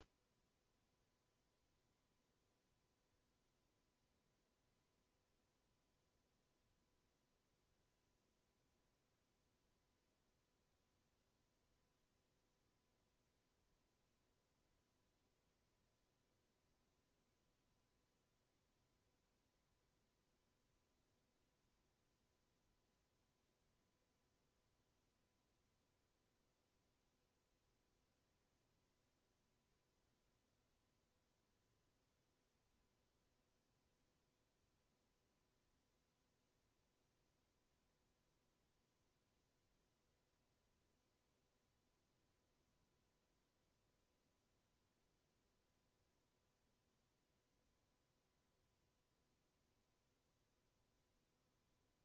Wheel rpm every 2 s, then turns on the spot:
0, 0, 0, 0, 0, 0, 0, 0, 0, 0, 0, 0, 0, 0, 0, 0, 0, 0, 0, 0, 0, 0, 0, 0, 0, 0.
none